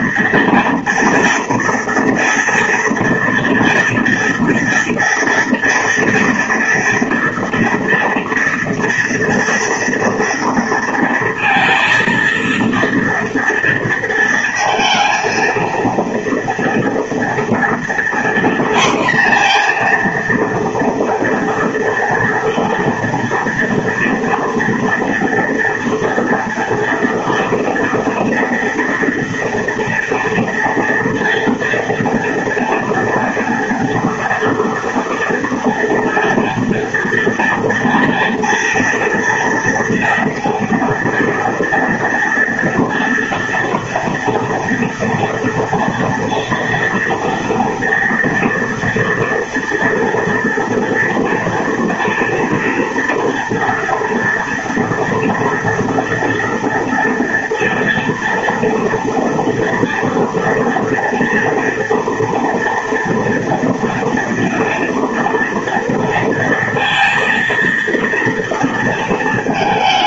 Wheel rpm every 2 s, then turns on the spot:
230, 230, 230, 230, 230, 230, 230, 230, 230, 240, 240, 230, 230, 230, 230, 230, 230, 240, 230, 230, 230, 230, 230, 230, 230, 230, 230, 230, 230, 230, 230, 230, 240, 230, 230.
none